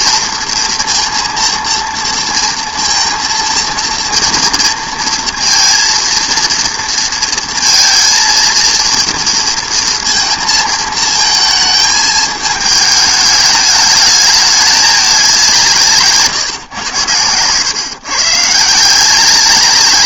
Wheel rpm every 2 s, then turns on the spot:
230, 230, 230, 230, 230, 220, 220, 210, 130, 160.
none